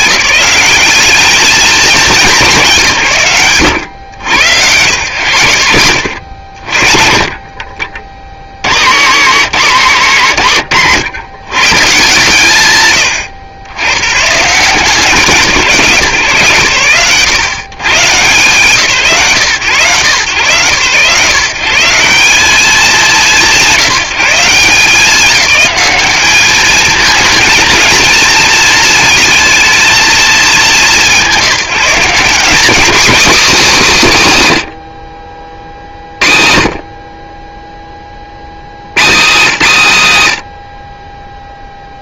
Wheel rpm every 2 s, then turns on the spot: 190, 160, 110, 80, 80, 100, 150, 180, 110, 130, 120, 190, 180, 220, 220, 180, 260, 70, 50, 120, 30.
10-12